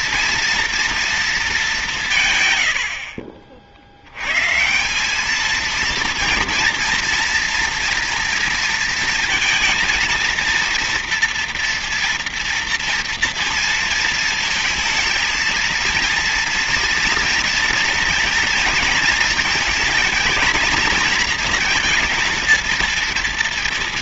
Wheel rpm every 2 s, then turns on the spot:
230, 130, 120, 230, 230, 230, 240, 230, 230, 230, 230, 230.
none